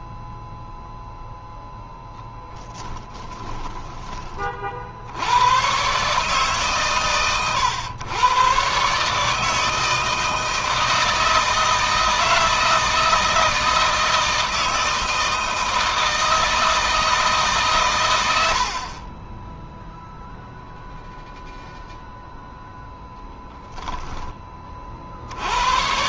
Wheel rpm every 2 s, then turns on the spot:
0, 10, 60, 140, 130, 160, 160, 160, 160, 40, 0, 0, 40.
2-4